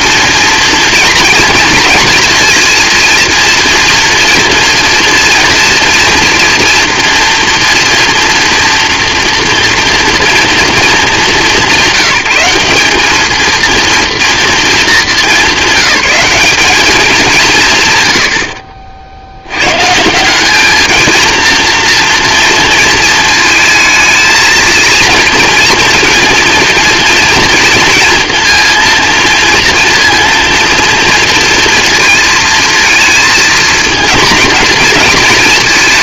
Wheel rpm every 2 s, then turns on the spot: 230, 230, 230, 230, 230, 220, 210, 220, 190, 60, 220, 230, 230, 230, 230, 230, 230, 230.
none